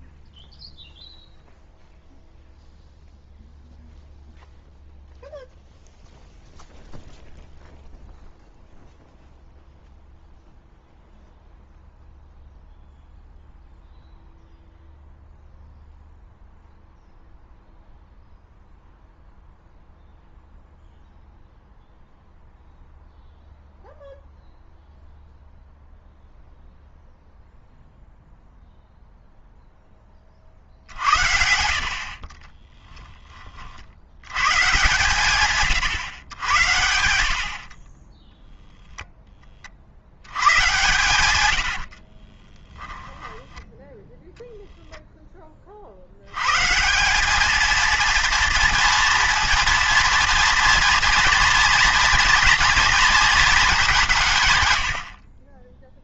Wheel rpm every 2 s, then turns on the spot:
0, 0, 0, 0, 0, 0, 0, 0, 0, 0, 0, 0, 0, 0, 0, 60, 30, 130, 80, 0, 100, 20, 0, 140, 230, 230, 230, 130.
32-34 42-44 54-56